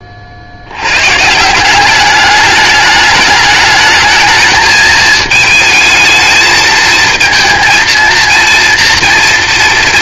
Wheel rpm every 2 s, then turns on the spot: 110, 210, 220, 220, 230.
none